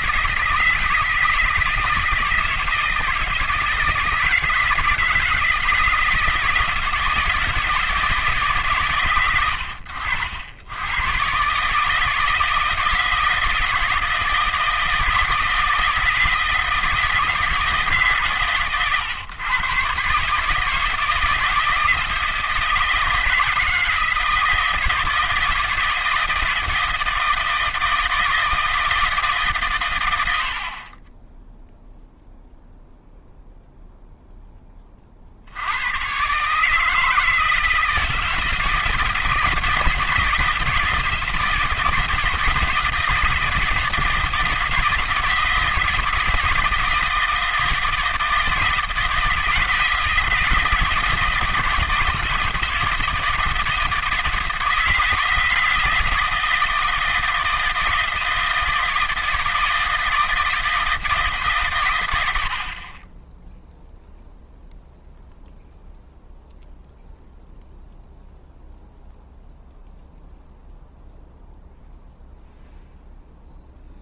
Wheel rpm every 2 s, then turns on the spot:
160, 160, 160, 160, 150, 80, 160, 160, 160, 130, 150, 160, 160, 160, 160, 70, 0, 10, 140, 170, 160, 160, 160, 160, 160, 170, 160, 160, 160, 160, 160, 80, 0, 0, 0, 0, 0.
none